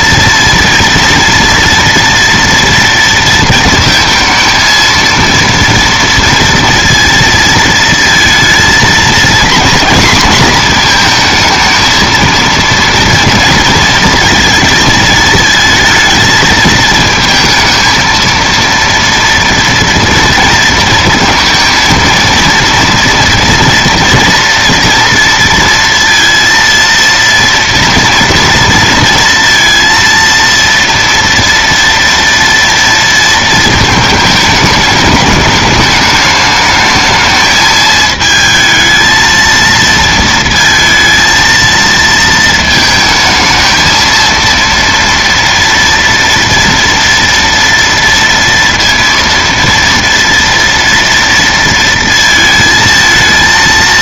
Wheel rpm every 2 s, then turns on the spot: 230, 230, 230, 240, 230, 230, 230, 230, 220, 230, 230, 230, 230, 230, 230, 230, 230, 210, 220, 220, 230, 220, 230, 230, 230, 230, 220.
none